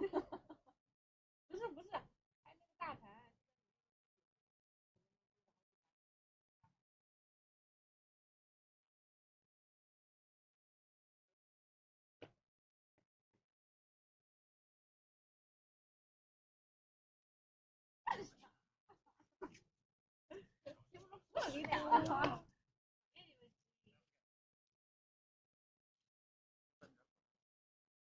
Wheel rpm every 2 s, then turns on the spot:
0, 0, 0, 0, 0, 0, 0, 0, 0, 0, 0, 0, 0, 0.
none